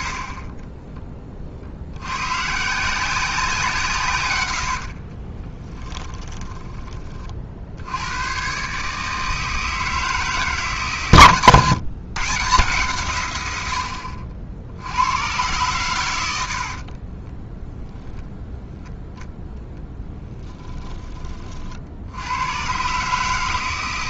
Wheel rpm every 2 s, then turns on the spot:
20, 170, 70, 20, 140, 150, 140, 70, 40, 0, 20, 130.
4-6 16-18